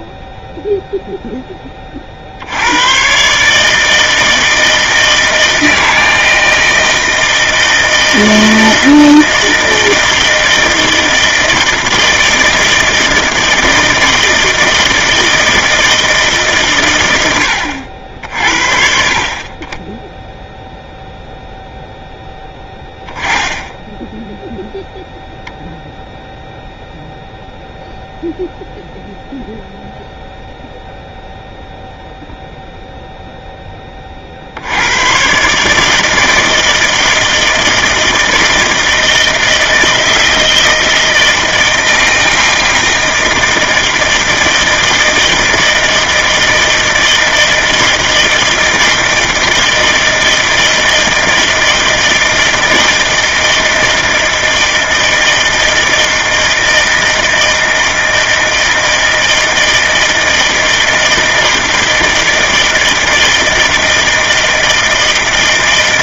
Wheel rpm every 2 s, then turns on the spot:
10, 150, 160, 160, 160, 160, 160, 160, 90, 30, 0, 10, 0, 0, 0, 0, 0, 110, 160, 160, 160, 160, 160, 160, 160, 160, 160, 160, 160, 160, 160, 160, 160.
none